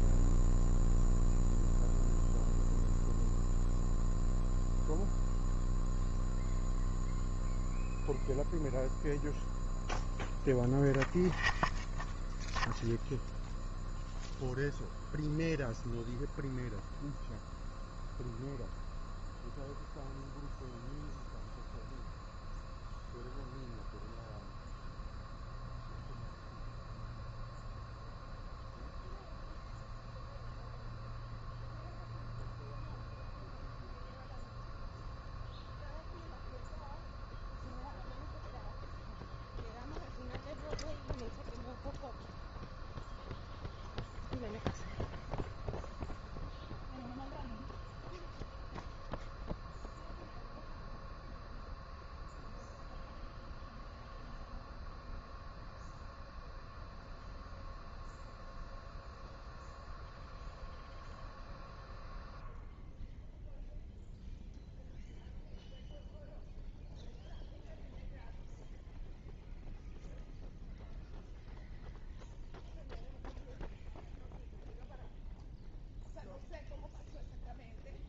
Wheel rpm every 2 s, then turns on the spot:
0, 0, 0, 0, 0, 0, 0, 0, 0, 0, 0, 0, 0, 0, 0, 0, 0, 0, 0, 0, 0, 0, 0, 0, 0, 0, 0, 0, 0, 0, 0, 0, 0, 0, 0, 0, 0, 0, 0.
none